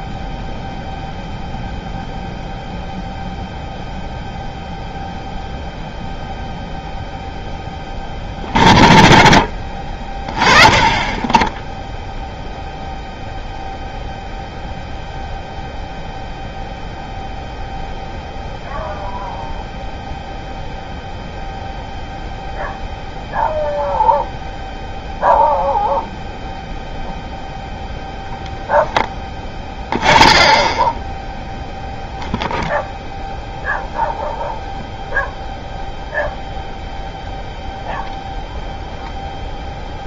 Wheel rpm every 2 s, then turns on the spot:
0, 0, 0, 0, 70, 30, 0, 0, 0, 0, 0, 0, 0, 0, 10, 10, 0, 0, 0, 0.
none